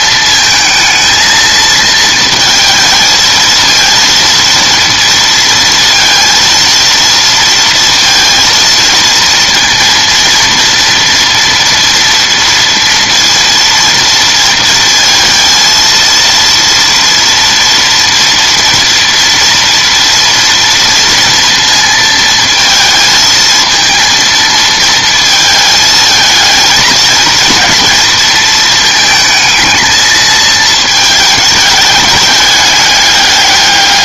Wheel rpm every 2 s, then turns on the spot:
230, 220, 230, 230, 230, 230, 230, 230, 230, 230, 230, 230, 230, 230, 220, 220, 210.
none